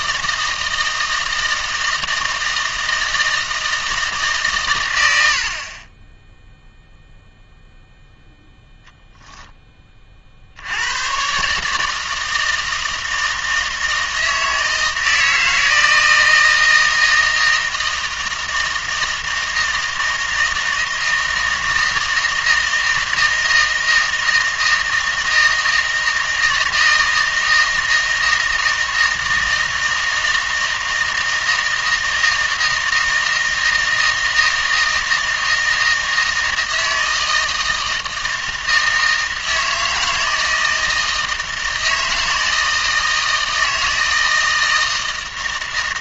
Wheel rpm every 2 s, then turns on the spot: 160, 160, 130, 0, 0, 70, 160, 160, 160, 160, 160, 160, 160, 160, 160, 160, 160, 160, 160, 160, 160, 160, 160.
none